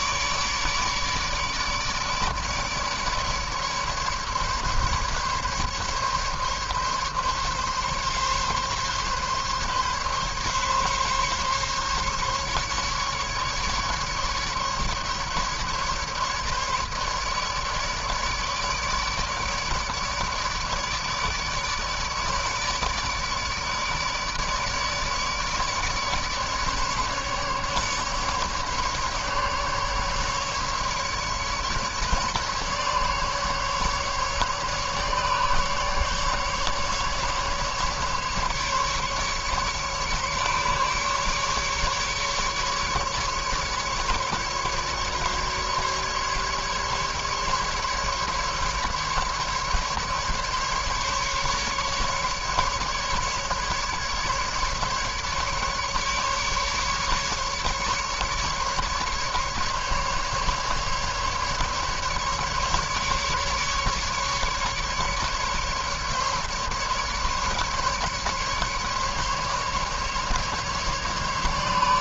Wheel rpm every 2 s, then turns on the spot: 150, 150, 140, 140, 140, 140, 140, 150, 150, 150, 150, 150, 150, 150, 150, 140, 150, 140, 140, 150, 150, 150, 150, 140, 140, 150, 150, 150, 140, 150, 150, 140, 140, 150, 150, 150.
none